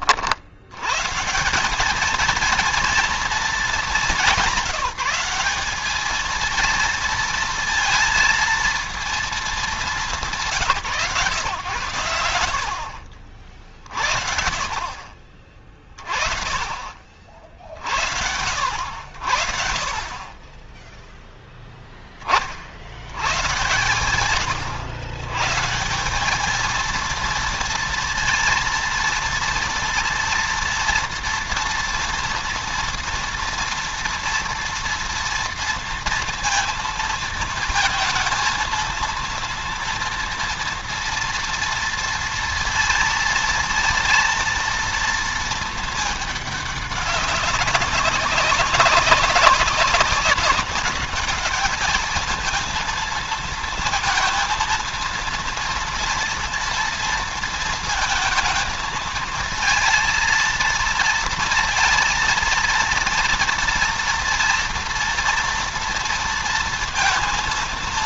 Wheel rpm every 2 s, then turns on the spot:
100, 230, 190, 230, 230, 170, 70, 60, 40, 70, 10, 70, 110, 220, 230, 230, 230, 230, 230, 230, 230, 230, 230, 200, 190, 190, 230, 230, 230, 230, 230, 230, 230, 230.
12-14